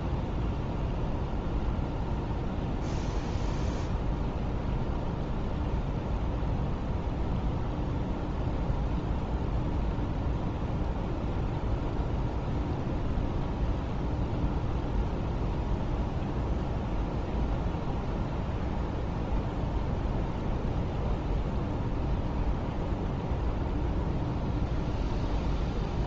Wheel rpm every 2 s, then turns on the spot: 0, 0, 0, 0, 0, 0, 0, 0, 0, 0, 0, 0, 0.
none